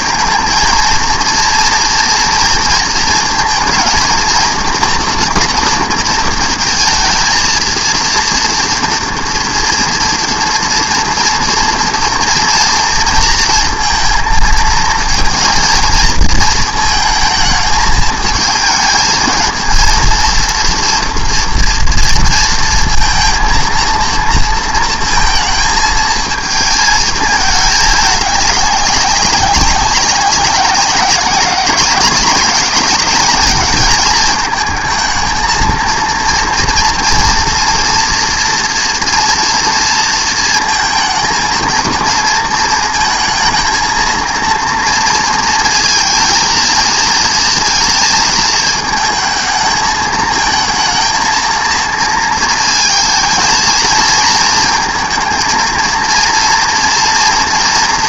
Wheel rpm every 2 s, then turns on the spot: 230, 230, 230, 220, 230, 230, 230, 230, 220, 220, 230, 230, 230, 220, 200, 190, 200, 220, 230, 230, 220, 220, 230, 230, 220, 230, 230, 230, 230.
none